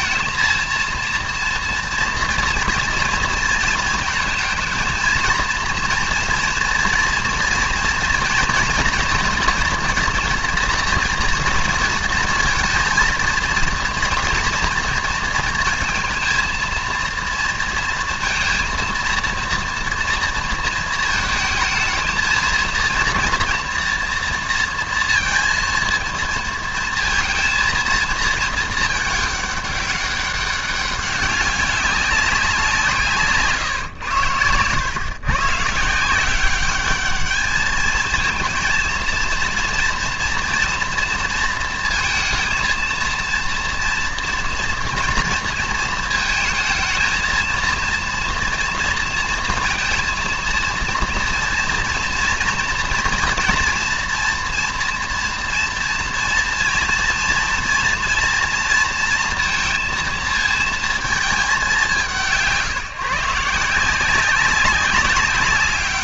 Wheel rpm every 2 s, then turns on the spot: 230, 230, 230, 230, 230, 230, 220, 230, 230, 230, 230, 220, 230, 220, 220, 200, 180, 100, 190, 220, 230, 220, 230, 220, 230, 230, 230, 230, 230, 230, 230, 170, 190.
none